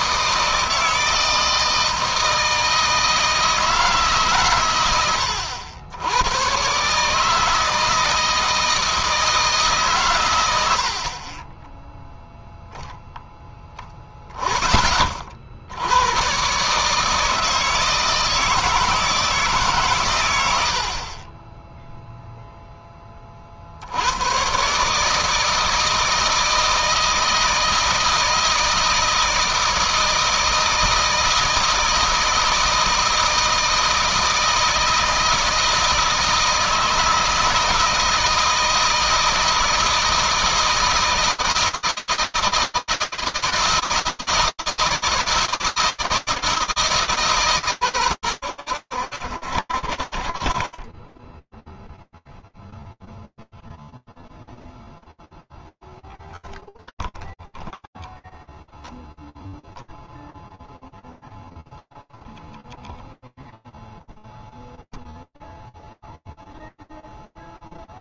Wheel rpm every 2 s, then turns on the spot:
160, 160, 100, 140, 160, 60, 0, 30, 150, 160, 60, 10, 150, 160, 160, 160, 160, 160, 160, 160, 160, 160, 160, 160, 90, 40, 0, 0, 0, 0, 0, 0, 0, 0.
none